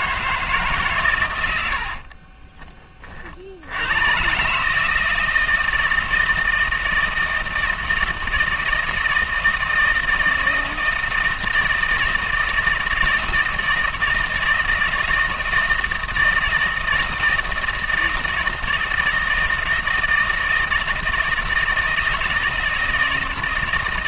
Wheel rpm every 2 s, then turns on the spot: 150, 30, 150, 170, 160, 160, 160, 160, 160, 160, 160, 160.
none